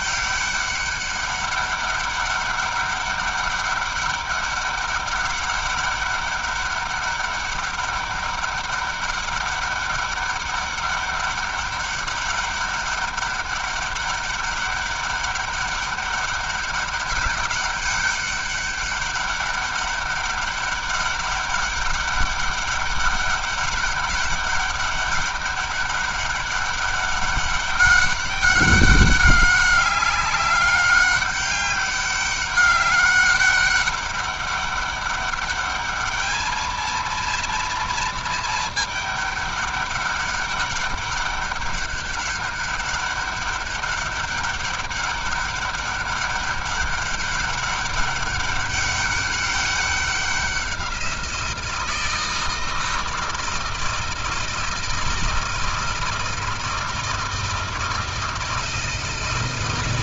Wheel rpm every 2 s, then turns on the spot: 200, 200, 200, 200, 200, 200, 200, 200, 200, 200, 200, 200, 200, 200, 200, 200, 200, 200, 220, 220, 200, 200, 200, 200, 200, 190, 160, 160, 160, 160.
none